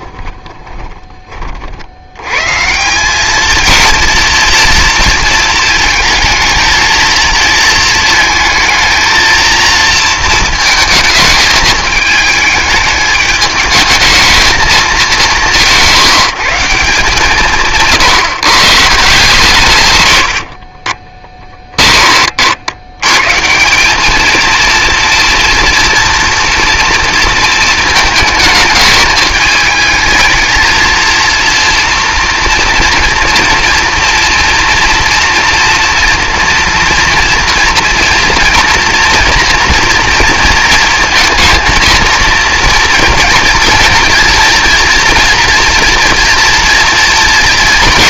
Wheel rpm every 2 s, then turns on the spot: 20, 140, 230, 220, 220, 230, 210, 220, 170, 160, 50, 60, 230, 230, 210, 230, 230, 230, 240, 230, 230, 230, 240, 230.
0-2 20-22